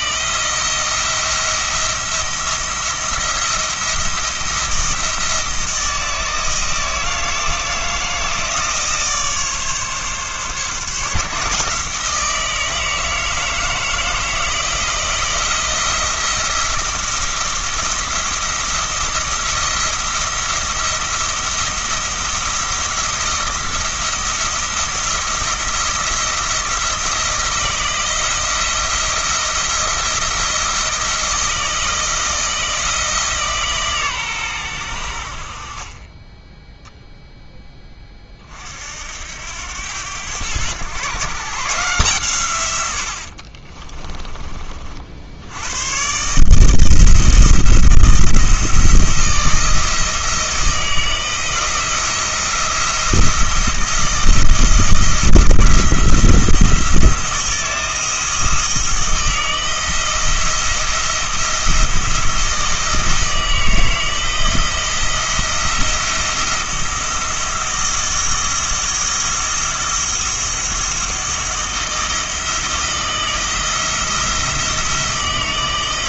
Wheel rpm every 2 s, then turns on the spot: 170, 170, 170, 160, 160, 140, 160, 170, 170, 170, 170, 170, 170, 170, 170, 170, 160, 110, 10, 50, 120, 100, 40, 160, 160, 160, 170, 160, 170, 160, 170, 160, 170, 170, 160, 170, 160, 160.
none